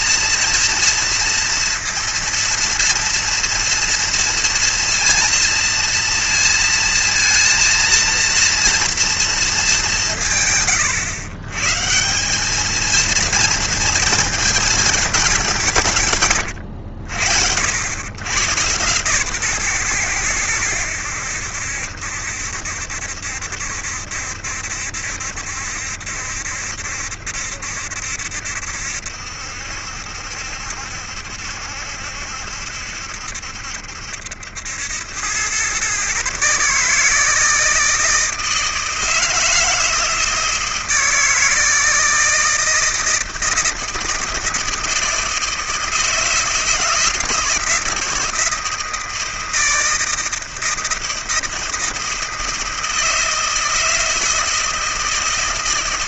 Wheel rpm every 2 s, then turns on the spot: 230, 230, 230, 230, 230, 120, 210, 220, 100, 120, 100, 70, 70, 70, 70, 70, 70, 90, 150, 160, 160, 160, 160, 160, 160, 160, 160, 160.
none